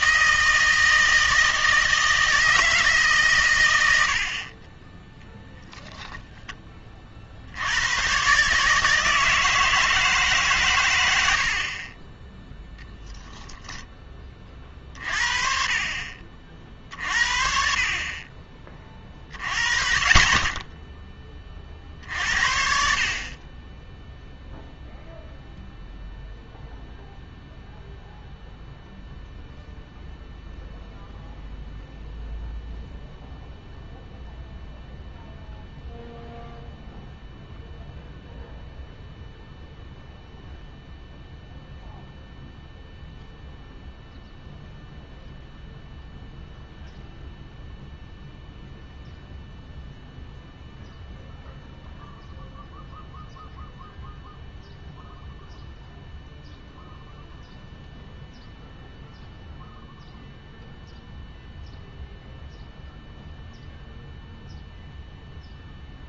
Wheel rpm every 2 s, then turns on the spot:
160, 160, 30, 20, 150, 120, 0, 40, 50, 30, 20, 60, 0, 0, 0, 0, 0, 0, 0, 0, 0, 0, 0, 0, 0, 0, 0, 0, 0, 0, 0, 0, 0.
none